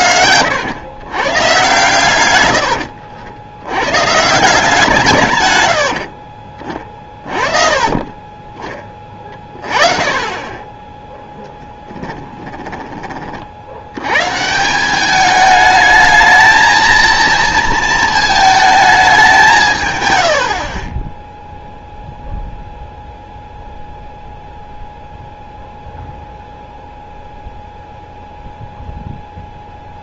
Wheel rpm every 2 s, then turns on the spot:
110, 100, 160, 30, 20, 20, 20, 180, 230, 210, 50, 0, 0, 0, 0.
6-8 20-22